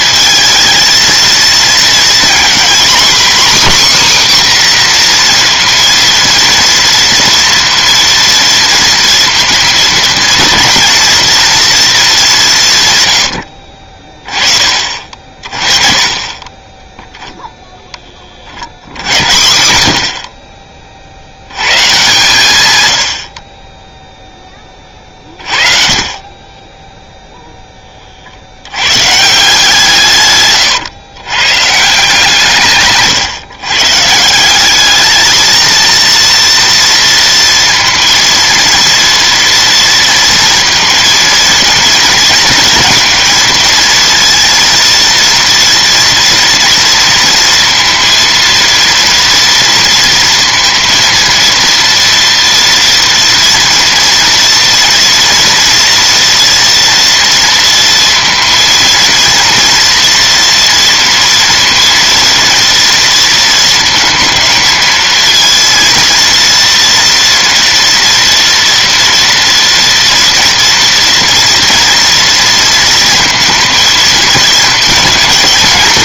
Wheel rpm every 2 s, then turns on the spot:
220, 250, 260, 230, 230, 230, 150, 40, 0, 70, 40, 100, 20, 10, 100, 130, 150, 210, 230, 230, 230, 230, 230, 230, 230, 230, 230, 230, 240, 230, 230, 230, 220, 230, 230, 230, 230, 220.
32-34